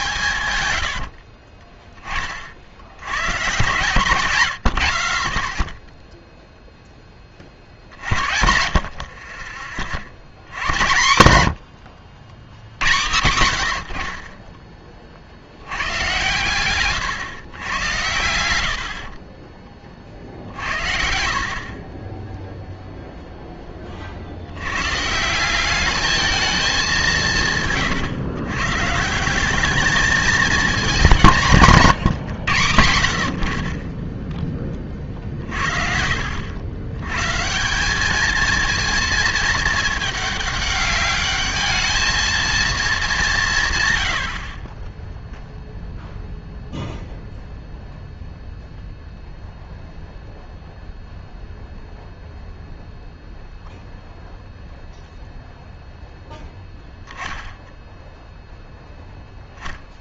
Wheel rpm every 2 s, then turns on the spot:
90, 60, 70, 0, 60, 110, 100, 20, 120, 60, 60, 0, 100, 200, 140, 210, 100, 20, 90, 220, 200, 220, 30, 0, 0, 0, 0, 0, 0, 0.
0-2 8-10